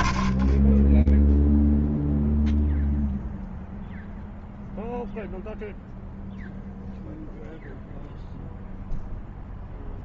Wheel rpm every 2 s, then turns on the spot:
30, 0, 0, 0, 0.
none